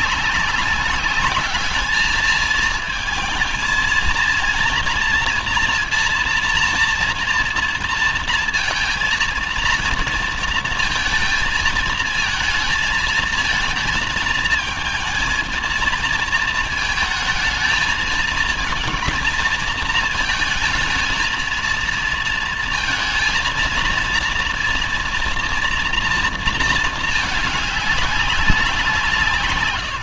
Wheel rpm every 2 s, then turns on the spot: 200, 220, 230, 230, 230, 230, 220, 220, 220, 230, 220, 230, 230, 220, 180.
none